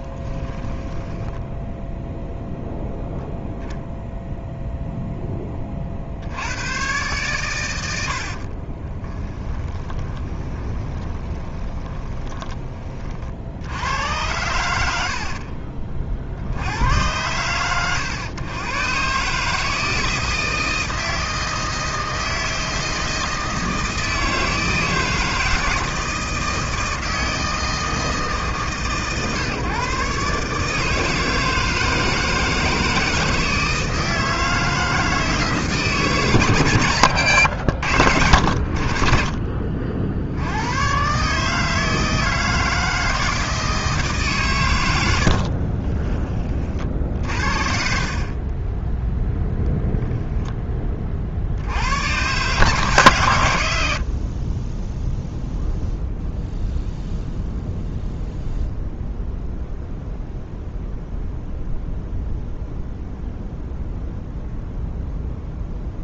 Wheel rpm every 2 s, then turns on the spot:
10, 0, 0, 110, 30, 20, 30, 80, 90, 120, 160, 160, 160, 160, 140, 160, 160, 160, 100, 50, 110, 160, 100, 40, 10, 30, 150, 10, 0, 0, 0, 0, 0.
0-2 8-12 36-38